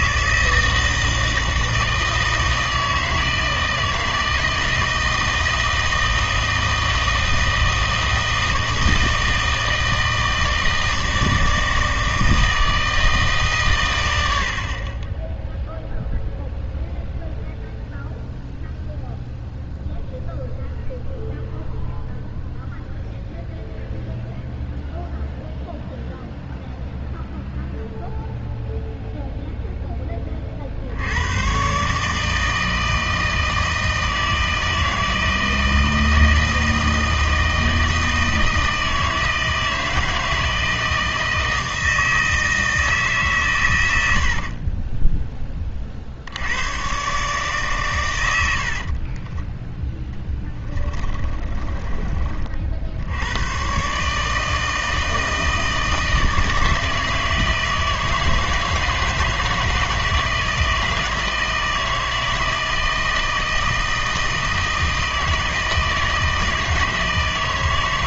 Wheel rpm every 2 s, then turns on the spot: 160, 160, 160, 160, 160, 160, 160, 60, 0, 0, 0, 0, 0, 0, 0, 50, 160, 160, 160, 160, 160, 160, 40, 90, 70, 20, 50, 160, 160, 160, 160, 160, 160, 160.
44-46 48-52